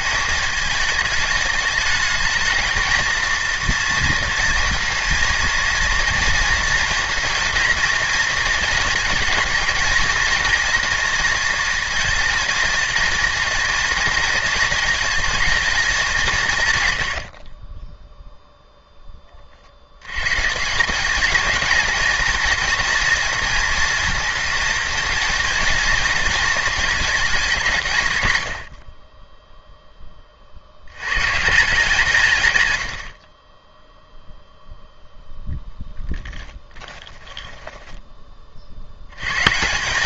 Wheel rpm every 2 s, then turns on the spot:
210, 230, 230, 230, 230, 230, 220, 220, 120, 10, 180, 230, 220, 220, 50, 80, 110, 0, 20, 70.
28-30 36-38